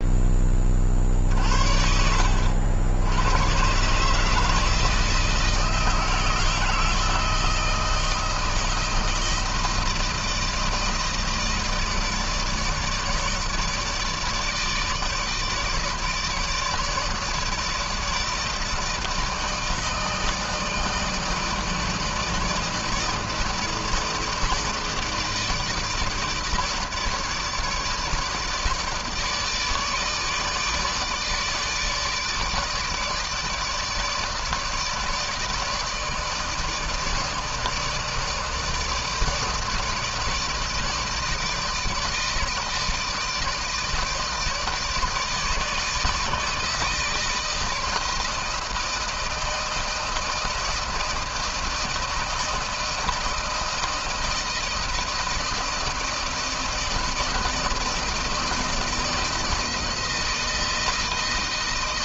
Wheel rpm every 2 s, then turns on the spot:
20, 80, 150, 160, 160, 160, 160, 150, 160, 160, 160, 160, 160, 160, 150, 150, 150, 160, 160, 160, 160, 160, 160, 160, 160, 160, 170, 160, 160, 160, 160.
none